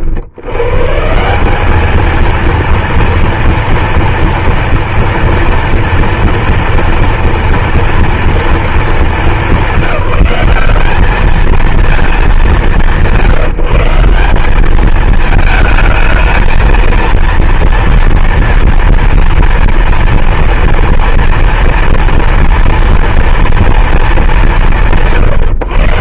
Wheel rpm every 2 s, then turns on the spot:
170, 230, 230, 230, 220, 210, 170, 220, 230, 230, 230, 230, 150.
none